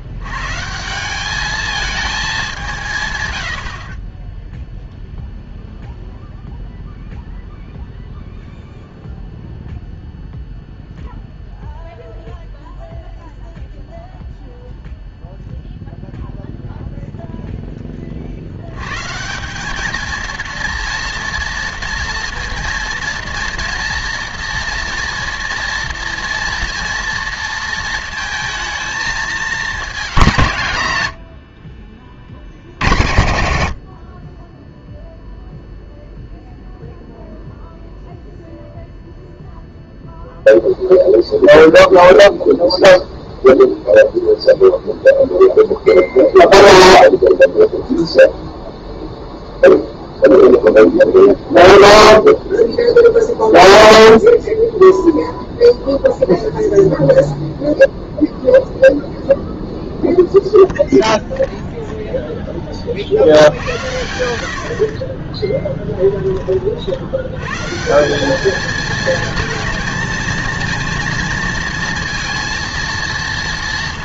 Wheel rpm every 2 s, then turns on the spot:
160, 180, 0, 0, 0, 0, 0, 0, 0, 90, 230, 230, 230, 230, 220, 140, 80, 10, 0, 0, 0, 0, 0, 0, 0, 0, 0, 0, 0, 0, 0, 20, 70, 40, 220, 230, 230.
none